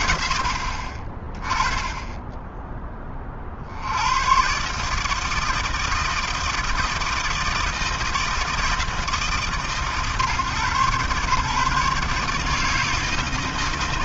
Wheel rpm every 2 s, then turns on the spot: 30, 50, 160, 160, 150, 140, 160.
none